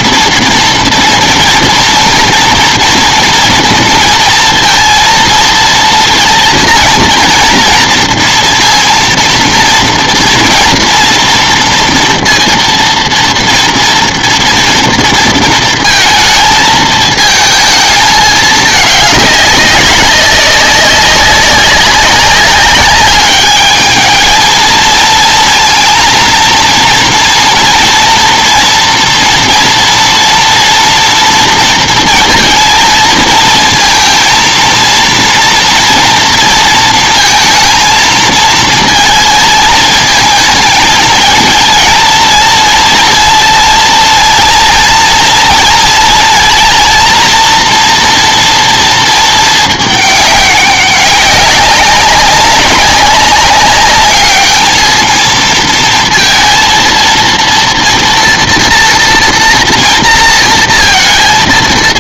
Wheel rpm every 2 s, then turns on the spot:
230, 230, 230, 230, 230, 230, 230, 230, 220, 200, 190, 200, 230, 230, 230, 230, 220, 230, 230, 220, 220, 230, 230, 230, 220, 200, 200, 220, 230, 230, 230.
none